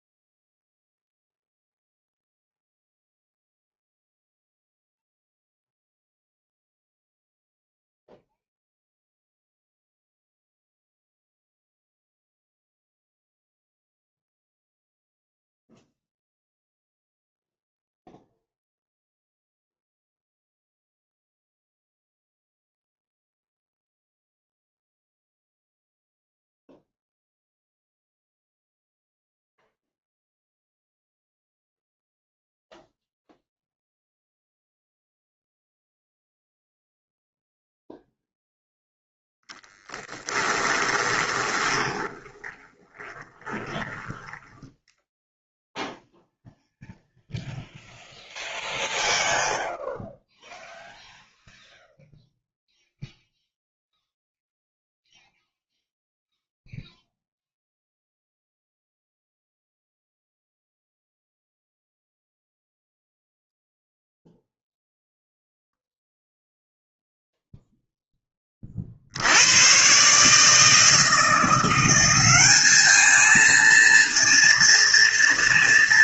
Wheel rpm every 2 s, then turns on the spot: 0, 0, 0, 0, 0, 0, 0, 0, 0, 0, 0, 0, 0, 0, 0, 0, 0, 0, 0, 0, 20, 20, 10, 0, 0, 0, 0, 0, 0, 0, 0, 0, 0, 0, 50, 160, 210, 230.
40-44